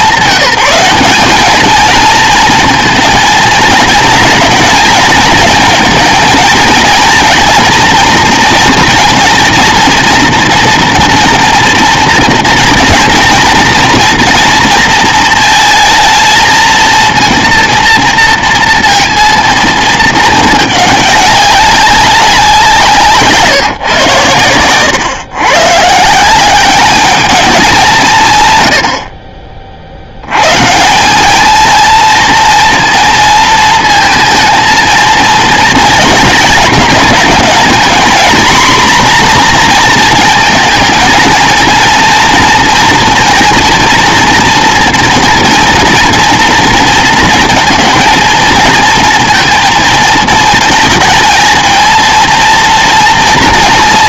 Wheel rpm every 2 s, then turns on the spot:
200, 230, 230, 230, 230, 230, 230, 230, 220, 230, 210, 170, 110, 200, 100, 160, 230, 220, 220, 250, 220, 230, 230, 230, 230, 220, 230.
none